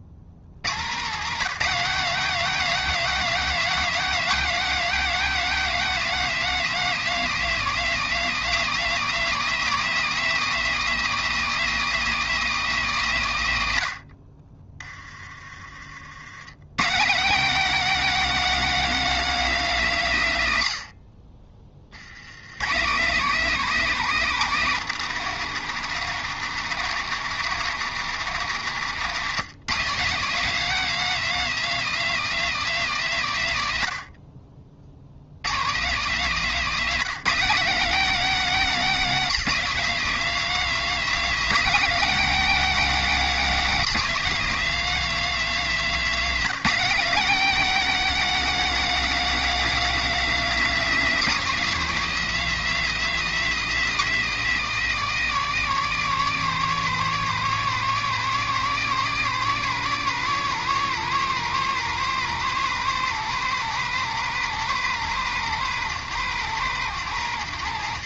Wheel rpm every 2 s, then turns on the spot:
110, 260, 250, 230, 240, 260, 240, 40, 140, 270, 110, 140, 220, 210, 200, 250, 240, 60, 220, 250, 250, 260, 250, 240, 270, 260, 260, 220, 210, 210, 210, 200, 200, 190.
28-30